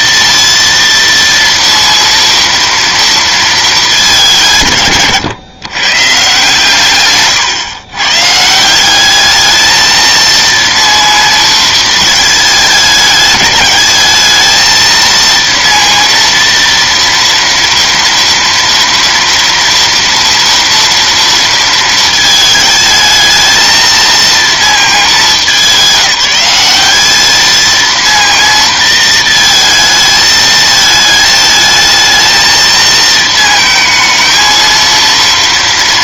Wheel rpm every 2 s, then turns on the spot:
230, 230, 170, 140, 160, 230, 210, 220, 230, 230, 230, 220, 230, 200, 230, 220, 220, 230.
none